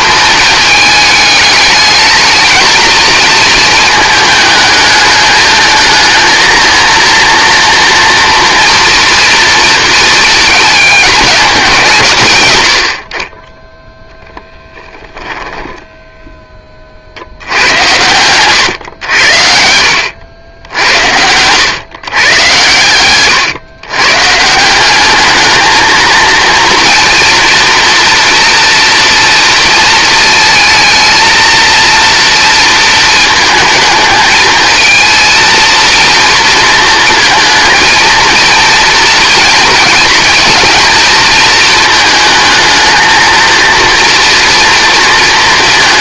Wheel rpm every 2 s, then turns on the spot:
220, 220, 210, 220, 230, 220, 130, 10, 30, 110, 80, 110, 180, 230, 230, 220, 230, 220, 230, 230, 230, 220, 230.
14-16